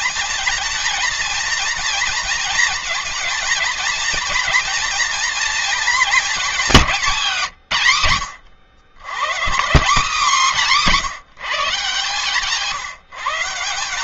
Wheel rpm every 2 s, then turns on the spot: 230, 230, 240, 210, 80, 180, 170.
none